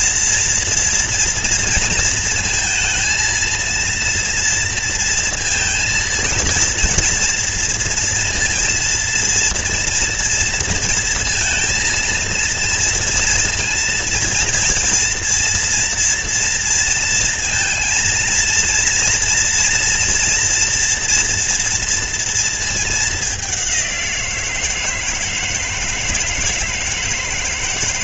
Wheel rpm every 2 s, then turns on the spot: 230, 230, 230, 230, 230, 230, 230, 230, 230, 230, 230, 230, 180, 160.
none